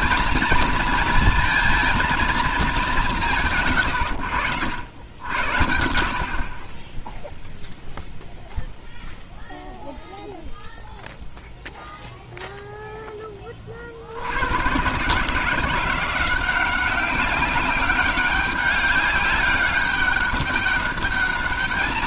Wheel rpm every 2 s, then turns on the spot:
230, 210, 110, 30, 0, 0, 0, 100, 180, 200, 200.
none